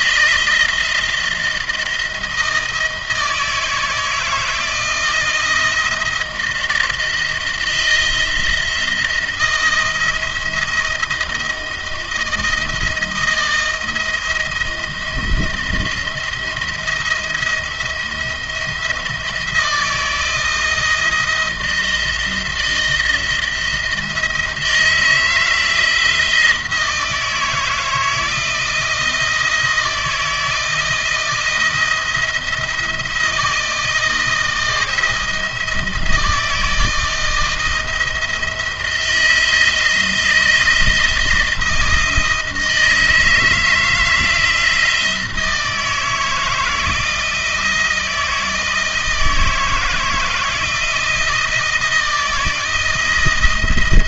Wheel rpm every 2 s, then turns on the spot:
160, 160, 160, 160, 160, 160, 170, 170, 170, 170, 160, 170, 160, 170, 160, 160, 160, 170, 160, 170, 170, 160, 160, 160, 160, 160, 170.
none